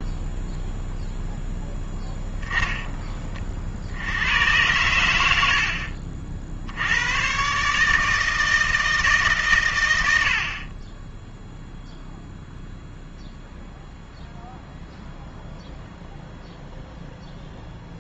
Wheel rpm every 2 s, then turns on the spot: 0, 20, 100, 100, 160, 20, 0, 0, 0.
none